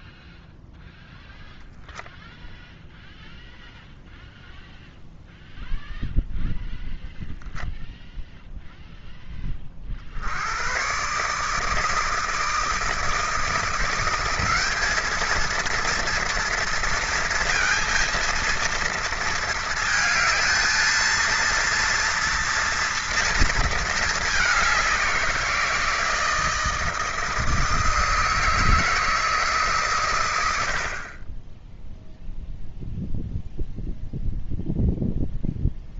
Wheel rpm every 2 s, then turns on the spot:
0, 0, 0, 0, 0, 100, 160, 200, 230, 230, 220, 230, 200, 160, 160, 90, 0, 0.
none